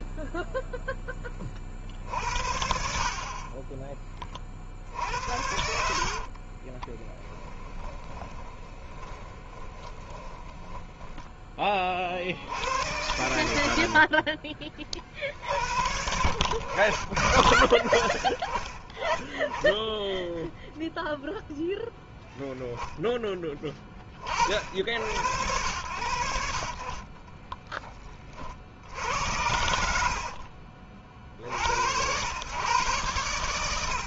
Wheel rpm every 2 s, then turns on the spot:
0, 60, 50, 20, 30, 20, 80, 40, 80, 30, 0, 10, 70, 70, 60, 50, 120.
6-12 26-28